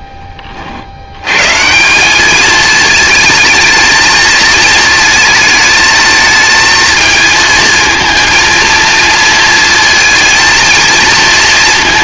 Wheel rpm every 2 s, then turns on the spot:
60, 220, 220, 220, 230, 230.
none